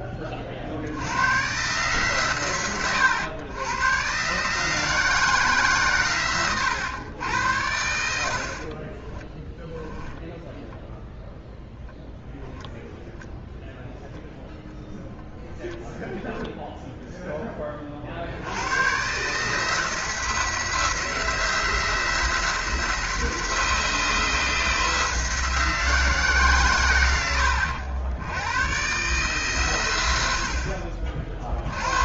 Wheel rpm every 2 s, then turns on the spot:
60, 110, 150, 110, 30, 10, 10, 0, 0, 100, 160, 160, 160, 130, 110, 60.
8-12